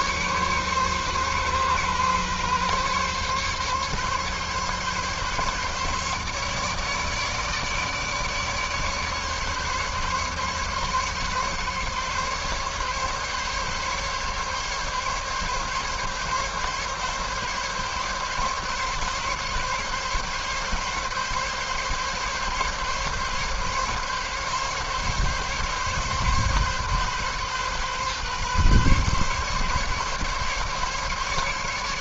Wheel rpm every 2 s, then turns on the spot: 130, 140, 140, 150, 150, 140, 140, 140, 140, 140, 140, 140, 140, 140, 140, 140.
none